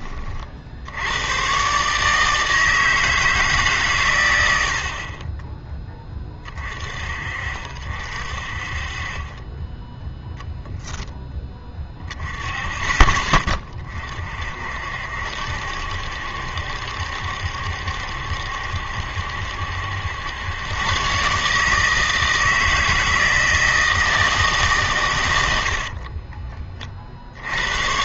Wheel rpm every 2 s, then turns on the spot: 60, 160, 80, 30, 40, 10, 20, 50, 70, 70, 110, 160, 140, 40.
none